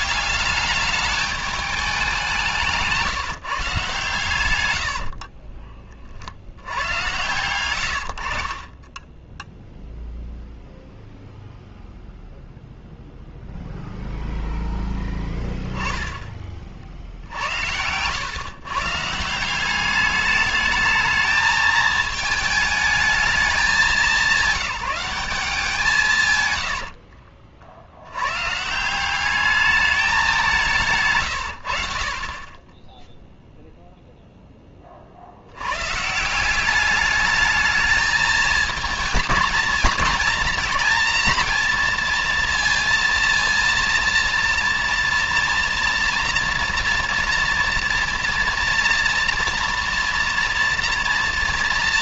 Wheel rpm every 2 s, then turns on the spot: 190, 180, 120, 60, 70, 0, 0, 0, 30, 120, 210, 220, 200, 120, 110, 190, 30, 10, 170, 220, 230, 230, 230, 230, 230, 230.
26-28